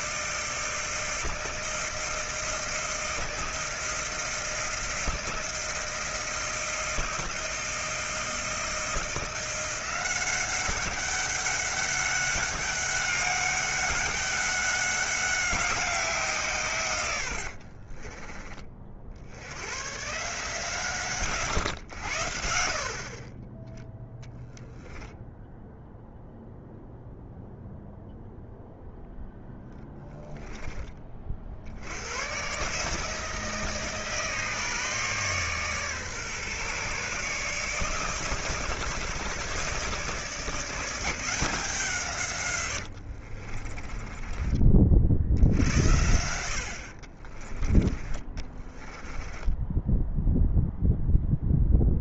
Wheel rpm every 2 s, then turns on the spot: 160, 160, 160, 160, 170, 190, 200, 200, 120, 50, 140, 60, 0, 0, 0, 20, 150, 150, 140, 150, 170, 80, 40, 60, 20, 0.
42-44 46-50